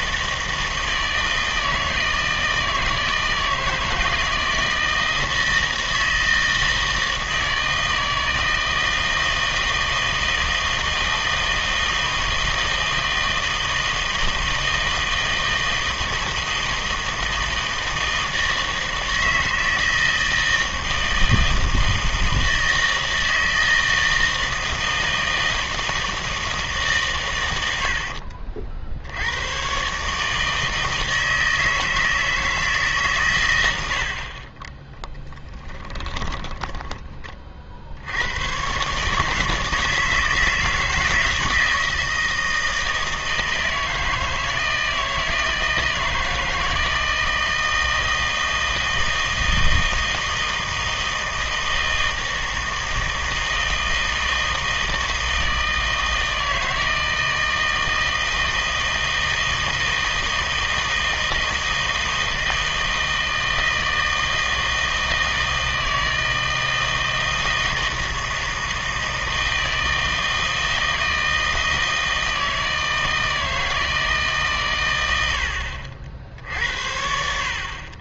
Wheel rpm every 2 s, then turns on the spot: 160, 160, 160, 160, 160, 160, 160, 160, 160, 160, 160, 160, 160, 160, 60, 160, 150, 30, 20, 120, 160, 160, 160, 160, 160, 160, 160, 160, 160, 160, 160, 160, 160, 160, 160, 160, 160, 130, 70.
34-38